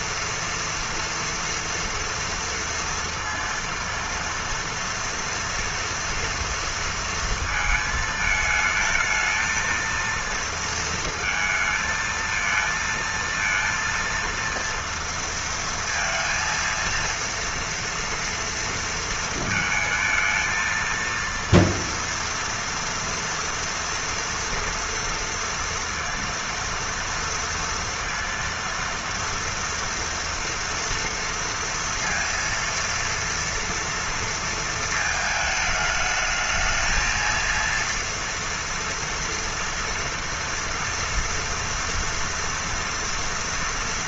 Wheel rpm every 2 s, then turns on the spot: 240, 230, 230, 230, 220, 230, 230, 230, 230, 230, 230, 240, 230, 230, 230, 230, 230, 230, 220, 230, 230, 230.
none